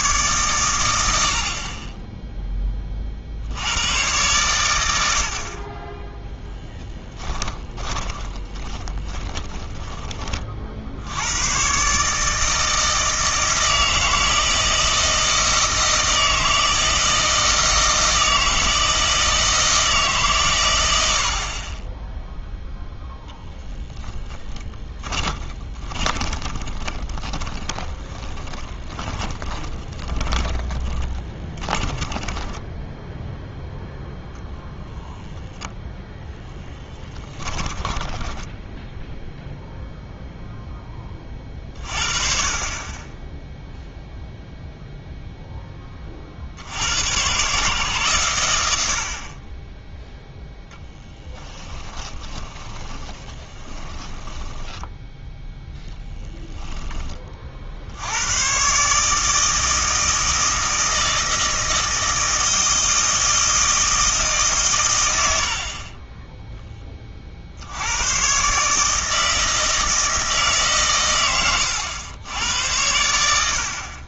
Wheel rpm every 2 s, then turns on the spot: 100, 30, 110, 10, 20, 60, 160, 160, 160, 160, 100, 0, 10, 20, 20, 20, 10, 0, 10, 0, 10, 20, 0, 80, 80, 10, 10, 10, 10, 140, 160, 160, 130, 10, 150, 140, 90.
6-10 24-34 52-56